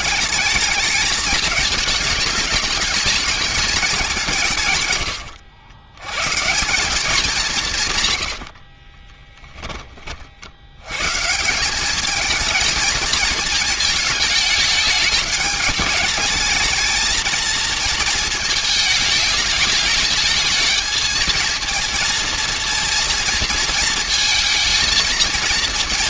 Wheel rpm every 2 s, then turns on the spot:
210, 210, 130, 170, 70, 70, 220, 210, 220, 220, 220, 230, 230.
8-10